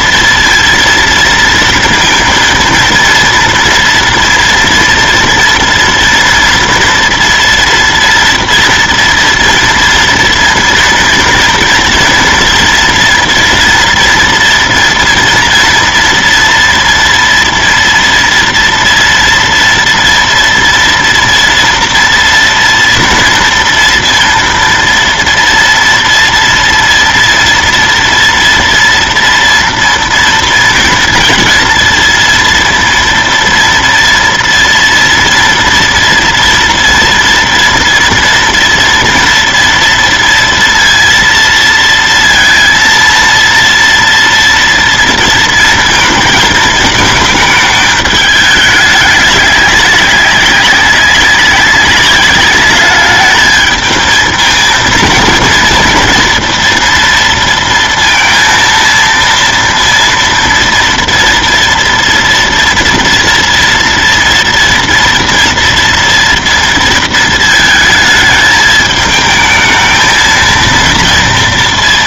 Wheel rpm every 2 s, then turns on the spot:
230, 230, 230, 230, 230, 230, 230, 230, 230, 230, 230, 230, 230, 230, 230, 230, 230, 230, 230, 230, 230, 230, 230, 220, 210, 200, 210, 230, 230, 230, 230, 230, 230, 230, 220, 230.
none